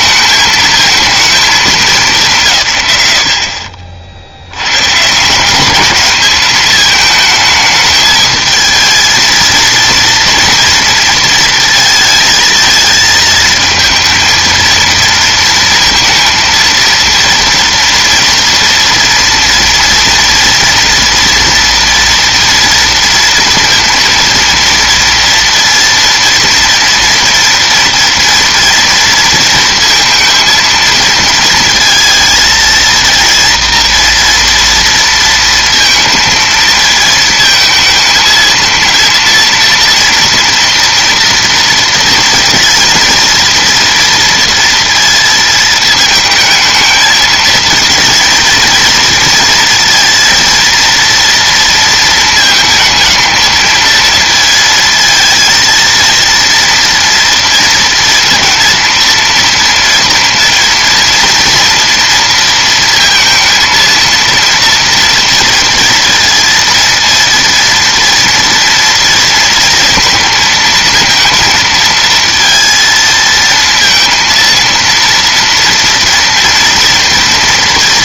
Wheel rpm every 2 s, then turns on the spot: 220, 90, 140, 220, 220, 230, 220, 230, 230, 230, 240, 230, 230, 230, 230, 230, 230, 230, 220, 230, 230, 230, 230, 220, 230, 230, 220, 220, 230, 230, 230, 230, 230, 230, 230, 230, 230, 230, 230.
none